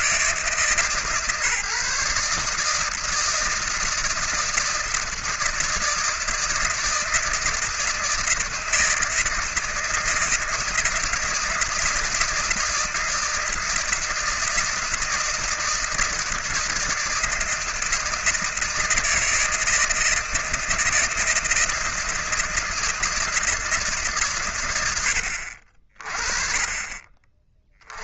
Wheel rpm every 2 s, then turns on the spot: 140, 160, 160, 160, 160, 160, 160, 160, 160, 160, 160, 160, 90, 30.
none